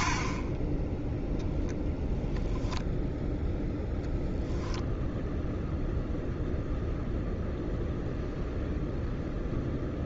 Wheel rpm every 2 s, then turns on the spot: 20, 0, 0, 0, 0.
none